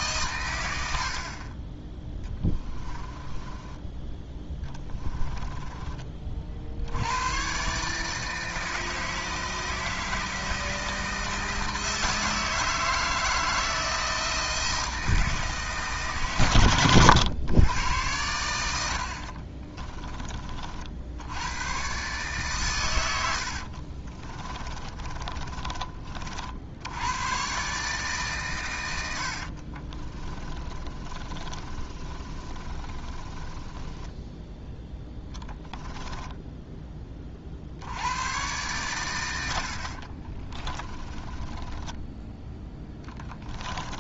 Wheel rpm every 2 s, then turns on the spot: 100, 20, 20, 80, 160, 160, 160, 160, 120, 80, 60, 110, 30, 80, 110, 30, 30, 10, 20, 120, 20, 10.
2-6 24-26 30-34 40-42